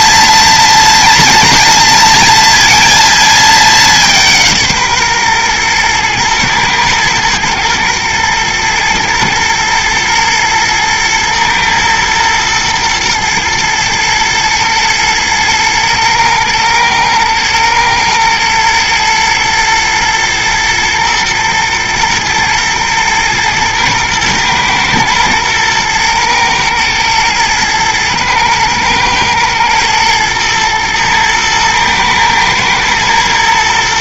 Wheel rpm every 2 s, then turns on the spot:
240, 230, 150, 120, 110, 120, 120, 110, 110, 110, 120, 120, 110, 110, 110, 110, 110.
none